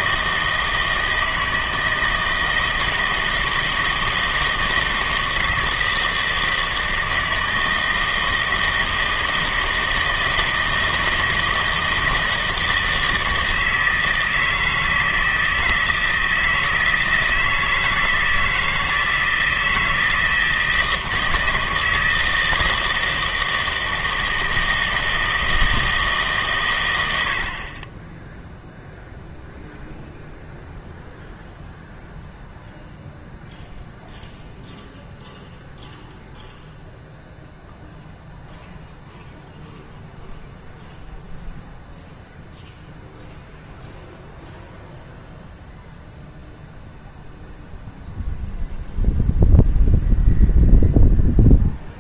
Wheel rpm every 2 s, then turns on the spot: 160, 160, 160, 160, 160, 160, 160, 160, 160, 160, 160, 160, 160, 110, 0, 0, 0, 0, 0, 0, 0, 0, 0, 0, 0, 0.
none